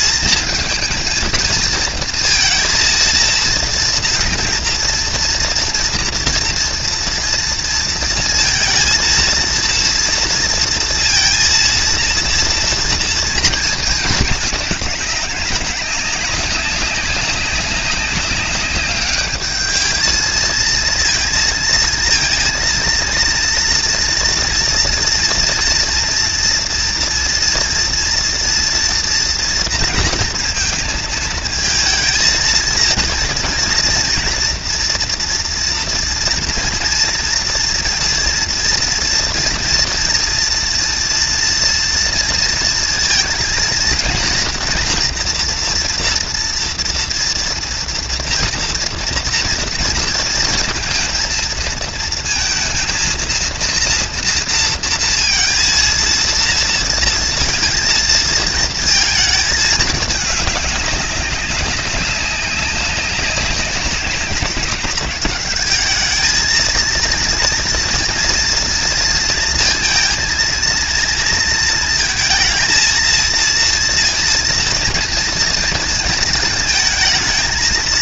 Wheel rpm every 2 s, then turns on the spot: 230, 230, 230, 230, 230, 230, 230, 210, 200, 200, 230, 230, 230, 230, 230, 230, 230, 230, 230, 230, 230, 230, 230, 230, 240, 230, 230, 230, 230, 220, 200, 200, 190, 230, 230, 230, 230, 230, 230.
none